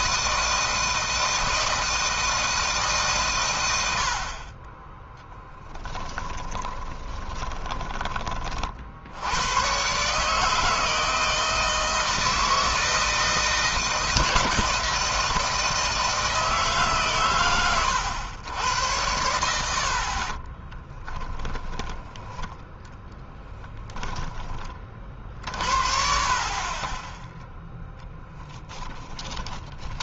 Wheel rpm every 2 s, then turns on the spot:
160, 140, 20, 20, 70, 160, 160, 160, 140, 100, 10, 10, 30, 20, 10.
4-8 20-24 28-30